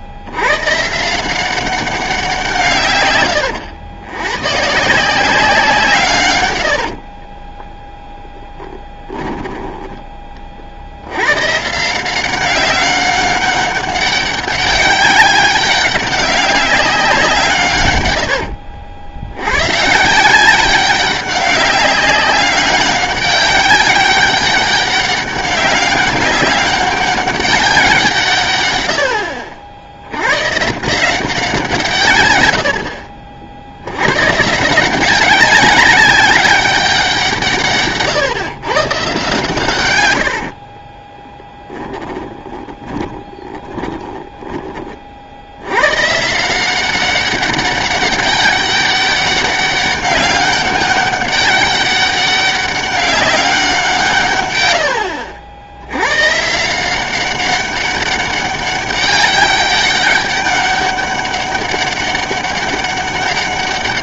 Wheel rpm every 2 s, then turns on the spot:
130, 140, 140, 80, 10, 50, 190, 200, 190, 70, 190, 200, 200, 200, 110, 140, 80, 170, 200, 130, 40, 20, 40, 180, 200, 200, 200, 80, 160, 200, 200, 200.
6-8 40-44